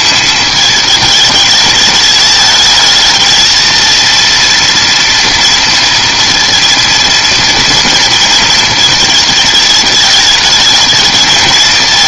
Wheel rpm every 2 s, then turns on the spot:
220, 210, 230, 230, 220, 220.
none